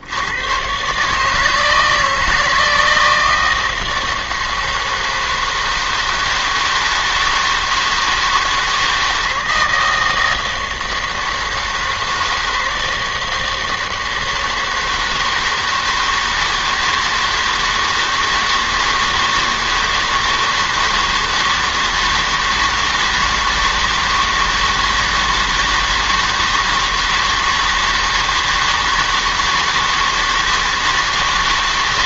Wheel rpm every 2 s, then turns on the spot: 110, 160, 160, 160, 160, 160, 160, 160, 160, 160, 160, 160, 160, 160, 160, 160.
none